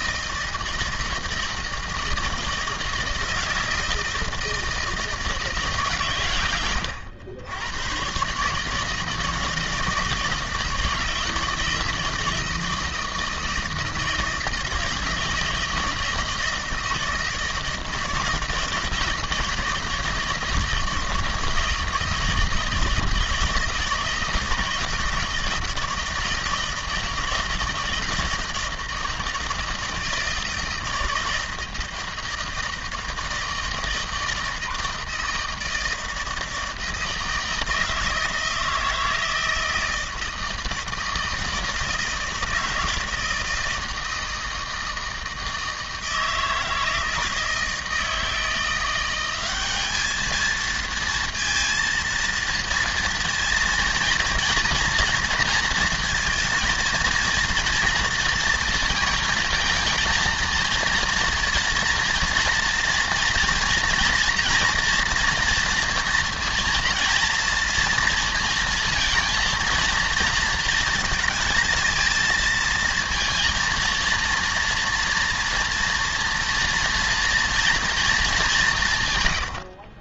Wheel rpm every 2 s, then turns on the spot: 160, 160, 160, 110, 150, 160, 160, 160, 160, 160, 160, 160, 160, 160, 160, 160, 160, 160, 160, 160, 160, 160, 160, 160, 170, 230, 230, 230, 230, 230, 230, 230, 230, 230, 230, 220, 220, 230, 230, 140.
none